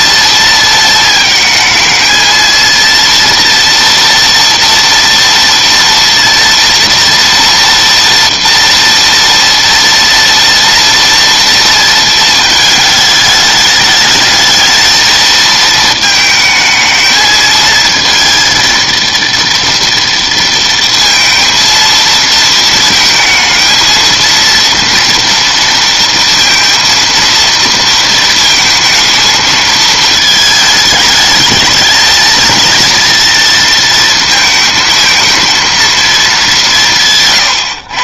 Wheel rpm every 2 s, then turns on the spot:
230, 230, 230, 230, 230, 230, 210, 220, 220, 230, 230, 220, 230, 230, 220, 220, 230, 220, 170.
none